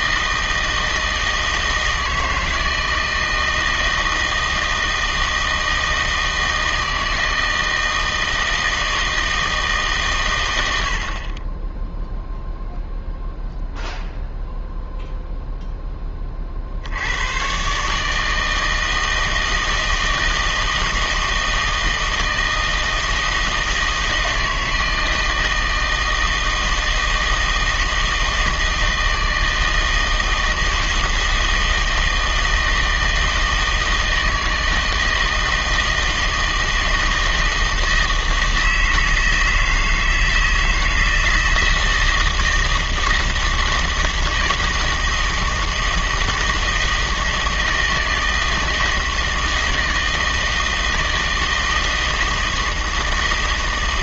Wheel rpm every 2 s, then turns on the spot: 160, 160, 160, 160, 160, 80, 0, 0, 60, 160, 160, 160, 160, 160, 160, 160, 160, 160, 160, 160, 160, 160, 160, 160, 160, 160, 160.
none